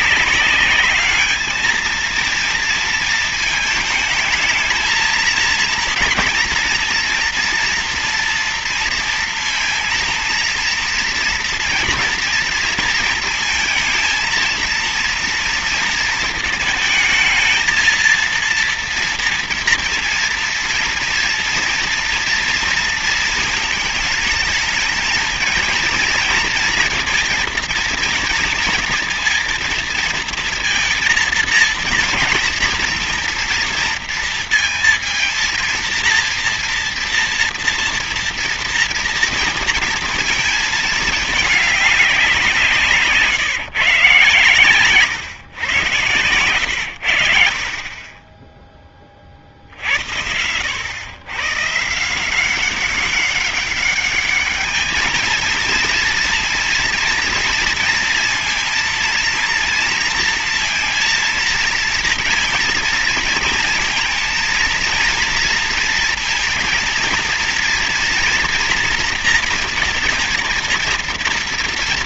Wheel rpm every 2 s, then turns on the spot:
200, 230, 230, 230, 230, 230, 230, 230, 220, 230, 230, 230, 220, 230, 230, 230, 230, 230, 230, 240, 220, 170, 140, 110, 20, 100, 190, 210, 240, 230, 230, 230, 230, 230, 230, 230.
none